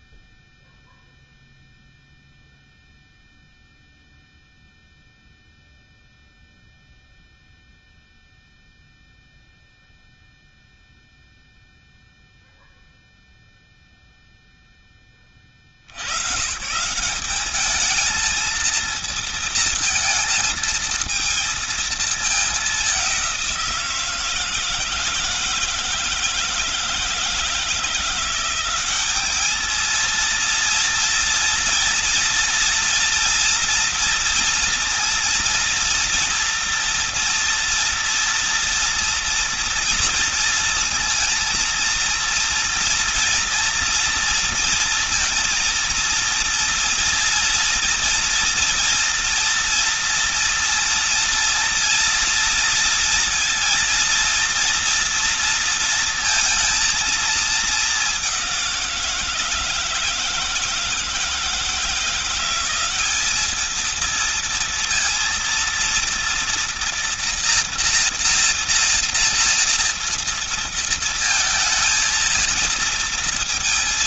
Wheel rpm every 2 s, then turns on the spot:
0, 0, 0, 0, 0, 0, 0, 10, 140, 220, 230, 210, 160, 160, 180, 230, 230, 230, 230, 230, 230, 230, 230, 230, 240, 230, 230, 230, 230, 190, 160, 180, 230, 230, 230, 230, 230.
none